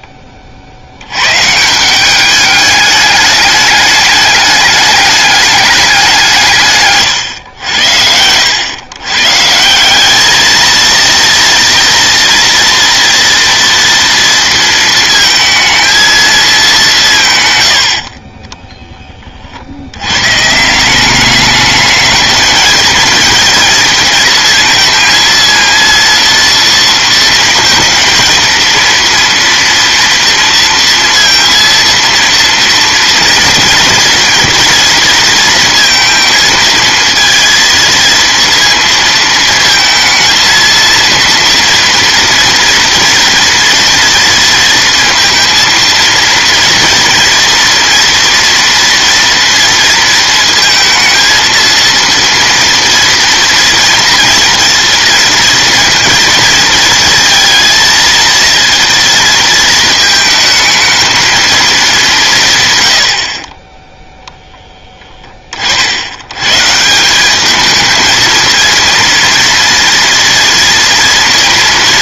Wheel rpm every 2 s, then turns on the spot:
20, 200, 210, 170, 90, 220, 240, 230, 220, 30, 150, 220, 230, 230, 230, 230, 230, 230, 230, 230, 230, 230, 230, 240, 240, 230, 230, 230, 230, 230, 220, 130, 10, 140, 230, 230.
18-20